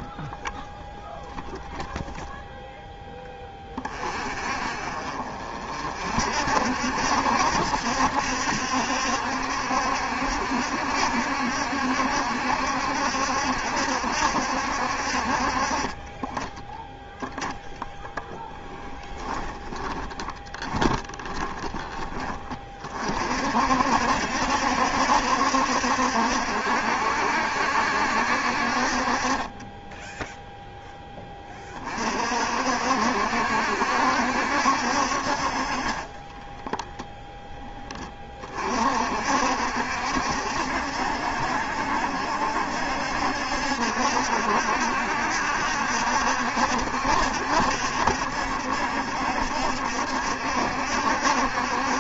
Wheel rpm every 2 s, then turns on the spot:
0, 0, 40, 60, 70, 70, 70, 60, 20, 10, 20, 30, 70, 70, 50, 0, 50, 60, 10, 40, 70, 70, 70, 70, 70, 70.
16-22 36-38